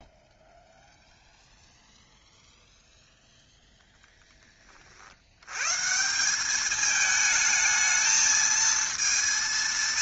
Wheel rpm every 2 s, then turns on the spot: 0, 0, 20, 200, 220.
none